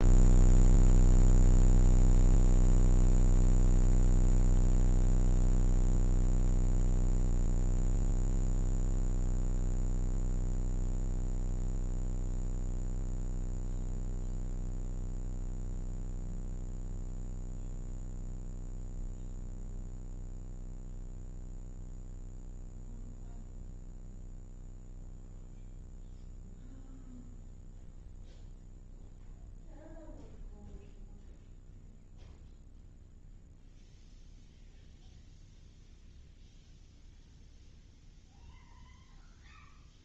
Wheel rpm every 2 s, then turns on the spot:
0, 0, 0, 0, 0, 0, 0, 0, 0, 0, 0, 0, 0, 0, 0, 0, 0, 0, 0, 0.
none